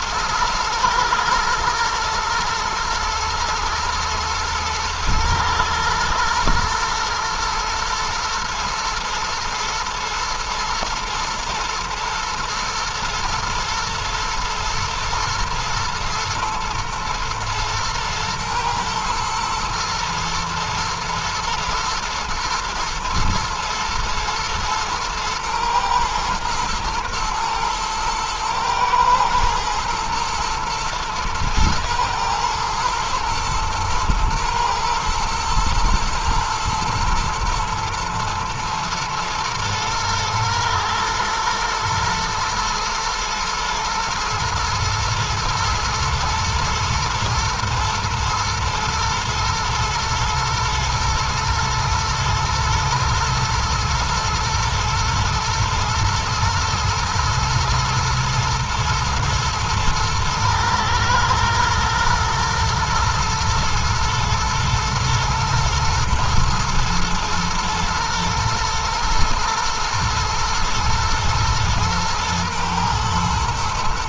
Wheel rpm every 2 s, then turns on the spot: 120, 120, 110, 120, 110, 120, 120, 110, 120, 120, 110, 110, 120, 110, 110, 110, 110, 110, 120, 110, 110, 110, 110, 120, 110, 120, 110, 120, 120, 110, 110, 110, 110, 120, 120, 110, 110.
none